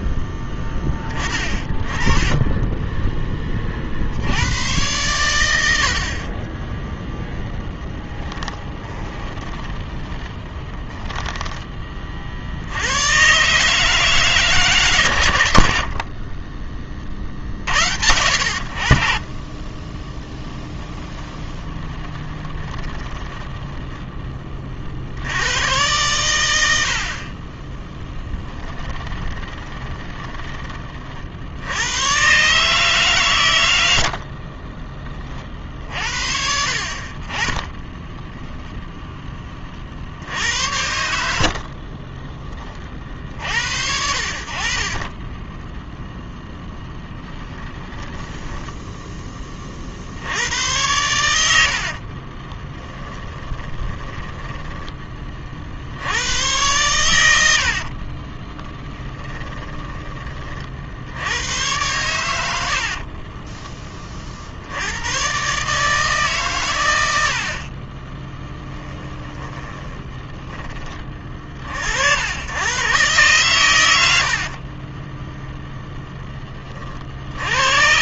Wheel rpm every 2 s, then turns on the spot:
20, 10, 100, 0, 20, 10, 100, 130, 40, 50, 10, 20, 50, 70, 20, 40, 140, 30, 30, 0, 70, 40, 30, 10, 10, 90, 10, 20, 100, 10, 70, 40, 100, 90, 20, 30, 120, 10, 70.
8-12 20-24 28-30 44-46 52-54 58-60 62-64 68-70 74-76